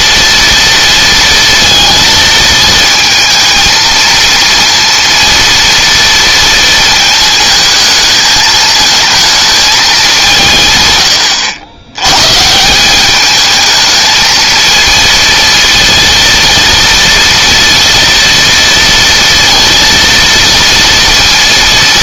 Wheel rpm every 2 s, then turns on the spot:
230, 220, 230, 230, 220, 130, 160, 230, 230, 230, 230.
none